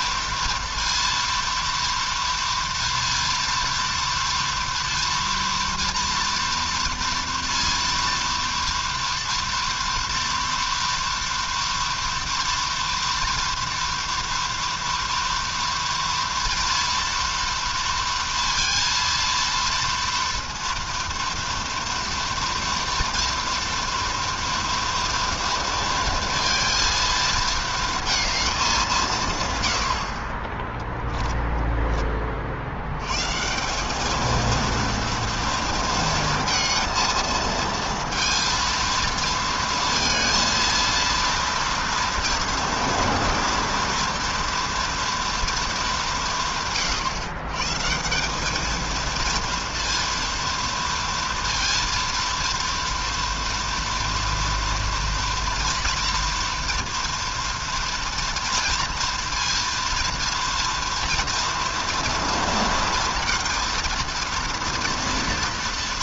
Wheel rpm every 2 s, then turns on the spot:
230, 230, 230, 230, 230, 230, 230, 240, 230, 230, 230, 230, 230, 230, 140, 10, 150, 230, 230, 230, 230, 230, 230, 130, 230, 230, 230, 230, 230, 230, 230, 230, 230.
none